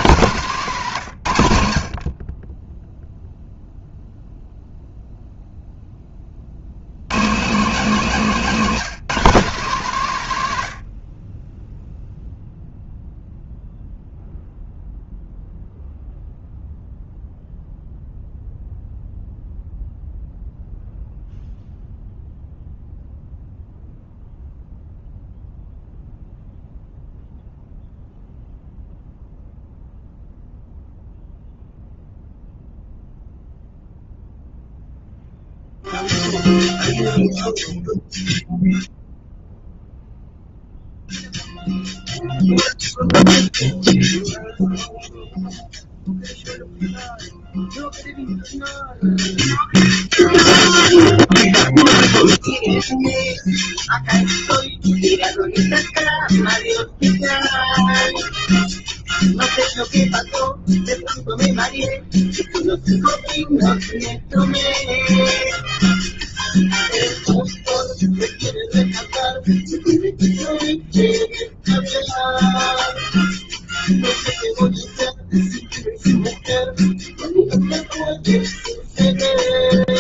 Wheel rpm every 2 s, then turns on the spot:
160, 20, 0, 90, 190, 90, 0, 0, 0, 0, 0, 0, 0, 0, 0, 0, 0, 0, 0, 0, 0, 0, 0, 0, 0, 0, 0, 0, 0, 0, 0, 0, 0, 0, 0, 0, 0, 0, 0, 0.
none